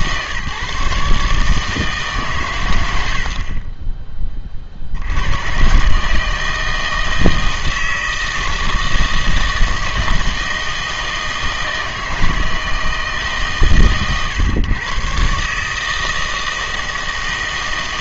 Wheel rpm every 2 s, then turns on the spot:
140, 100, 50, 160, 160, 160, 160, 120, 160.
none